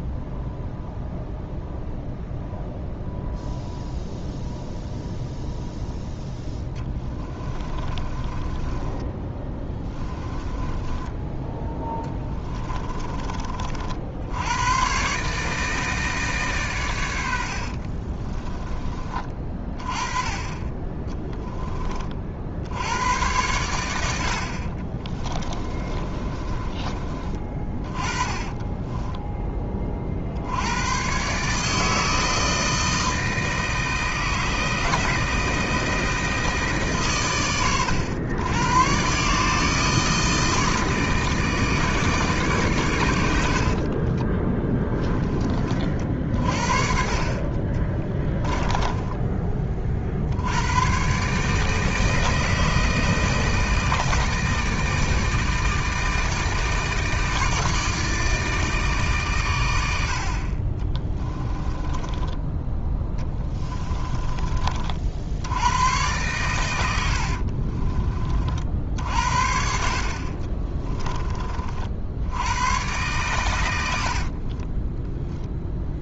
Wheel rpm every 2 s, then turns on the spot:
0, 0, 0, 10, 10, 10, 20, 120, 110, 30, 20, 90, 30, 30, 10, 100, 160, 160, 140, 120, 160, 120, 20, 50, 20, 110, 160, 160, 160, 150, 30, 10, 40, 90, 60, 20, 110, 20.
6-14 24-30 44-46 48-50 60-62 70-72 74-76